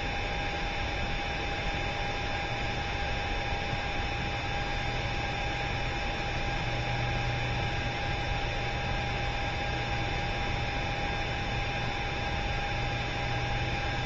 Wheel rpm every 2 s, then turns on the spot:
0, 0, 0, 0, 0, 0, 0.
none